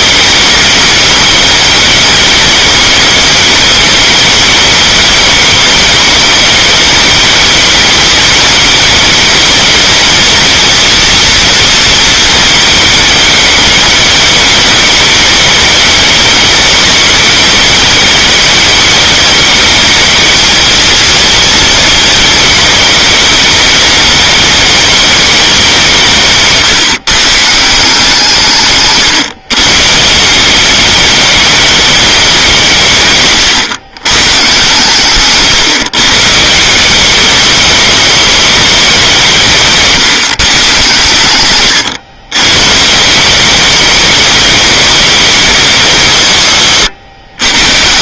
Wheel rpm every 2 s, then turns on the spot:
220, 210, 210, 210, 210, 230, 220, 210, 210, 210, 230, 220, 220, 150, 150, 190, 190, 130, 160, 210, 130, 120, 210, 140.
none